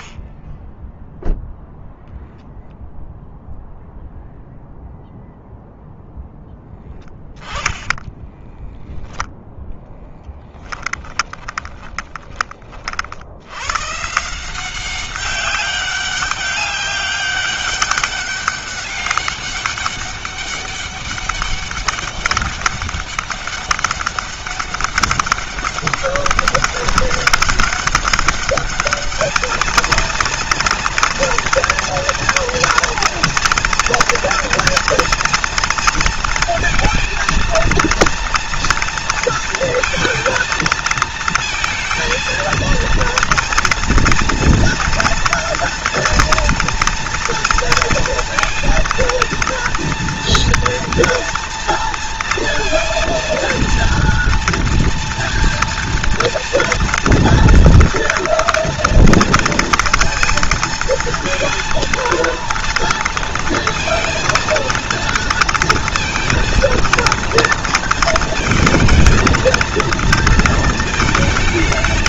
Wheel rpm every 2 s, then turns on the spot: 10, 0, 0, 10, 0, 10, 60, 190, 200, 200, 200, 200, 200, 200, 220, 230, 230, 230, 230, 230, 230, 240, 230, 230, 230, 230, 230, 230, 230, 230, 230, 230, 230, 230, 230, 220.
6-8 10-12